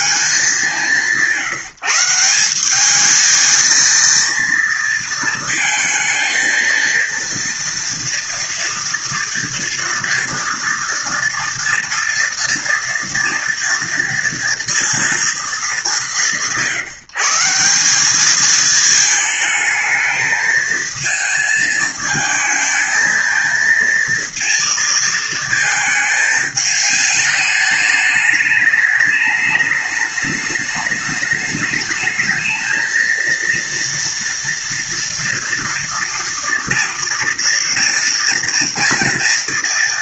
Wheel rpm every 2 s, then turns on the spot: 210, 180, 230, 230, 230, 230, 230, 230, 180, 210, 220, 220, 230, 220, 210, 210, 220, 230, 230, 230.
none